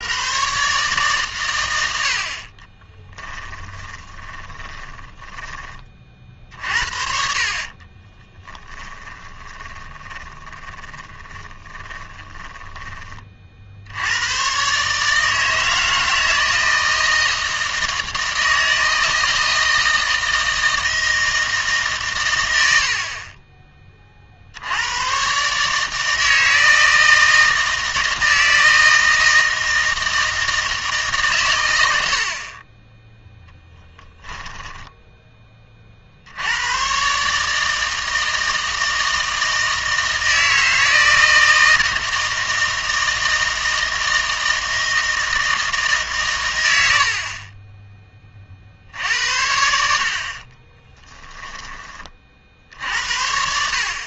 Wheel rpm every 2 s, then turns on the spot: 140, 30, 20, 50, 10, 20, 20, 130, 160, 160, 160, 90, 80, 160, 160, 160, 20, 10, 90, 160, 160, 160, 160, 100, 50, 30, 60.
2-6 8-14 34-36 50-54